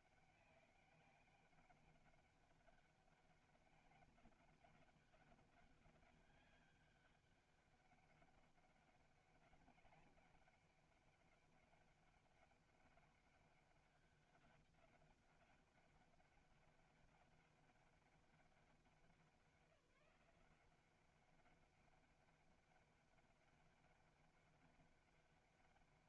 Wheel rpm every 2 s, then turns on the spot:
200, 200, 200, 200, 200, 200, 190, 200, 200, 190, 180, 190, 200.
none